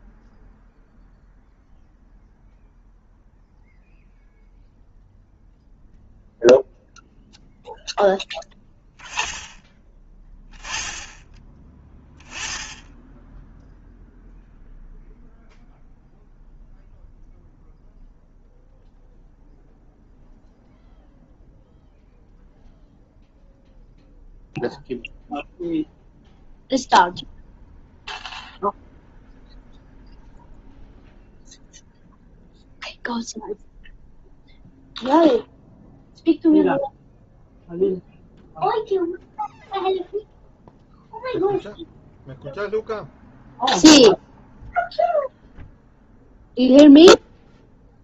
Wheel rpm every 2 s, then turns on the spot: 0, 0, 0, 0, 10, 10, 10, 0, 0, 0, 0, 0, 0, 0, 0, 0, 0, 0, 0, 0, 0, 0, 0, 0.
none